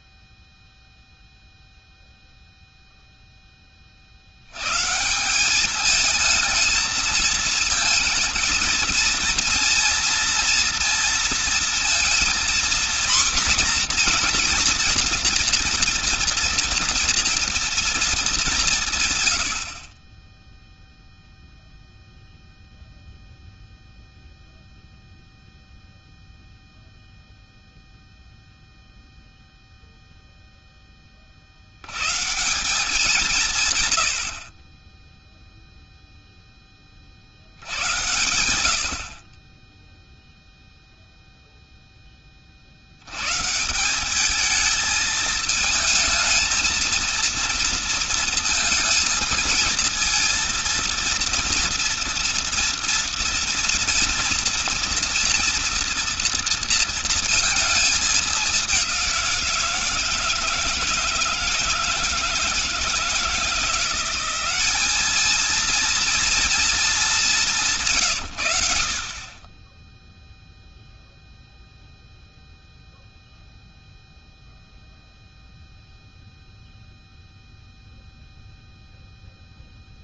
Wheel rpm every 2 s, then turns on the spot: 0, 0, 100, 220, 230, 230, 240, 240, 230, 180, 0, 0, 0, 0, 0, 0, 160, 50, 10, 90, 0, 50, 220, 220, 230, 230, 230, 230, 230, 200, 160, 160, 190, 230, 100, 0, 0, 0, 0, 0.
none